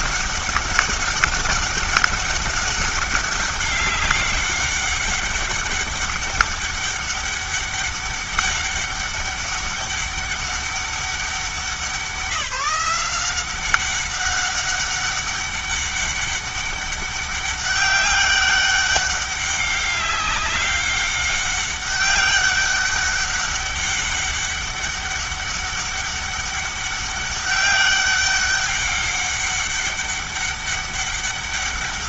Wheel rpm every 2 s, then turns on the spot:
200, 200, 200, 200, 200, 200, 180, 200, 200, 200, 200, 200, 200, 200, 200, 200.
none